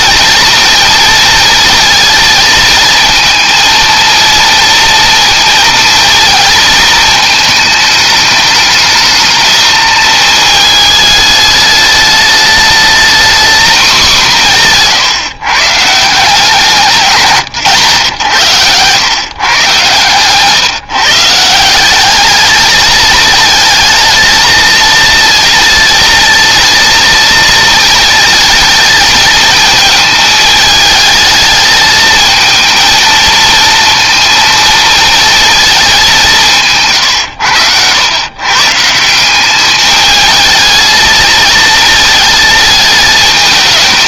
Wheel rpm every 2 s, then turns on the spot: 230, 230, 230, 220, 210, 210, 220, 160, 150, 120, 150, 220, 230, 230, 220, 220, 220, 230, 140, 170, 220, 220.
none